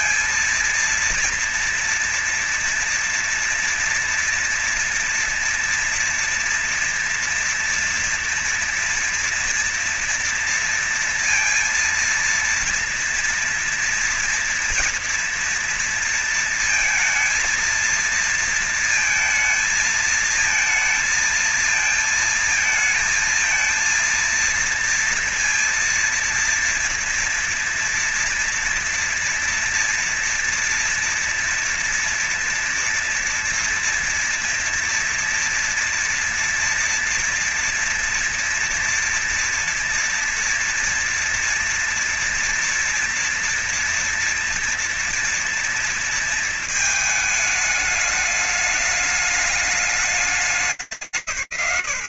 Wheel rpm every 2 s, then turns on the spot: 230, 230, 230, 230, 240, 230, 230, 230, 230, 230, 220, 220, 230, 230, 230, 230, 230, 230, 230, 240, 230, 230, 230, 220, 210, 200.
none